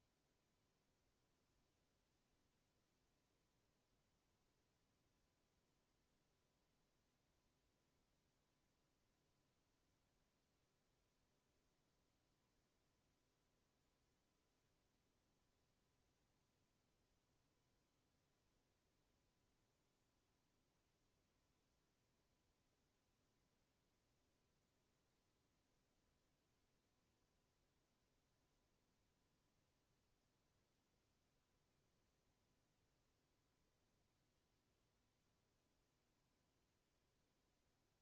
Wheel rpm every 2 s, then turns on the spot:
0, 0, 0, 0, 0, 0, 0, 0, 0, 0, 0, 0, 0, 0, 0, 0, 0, 0, 0.
none